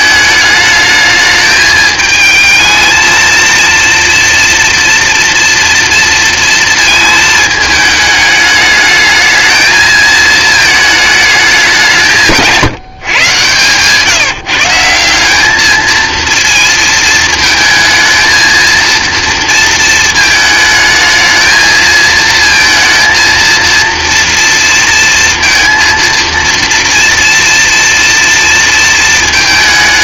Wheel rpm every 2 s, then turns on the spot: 220, 220, 230, 230, 210, 220, 150, 170, 230, 230, 220, 230, 230, 230, 230.
none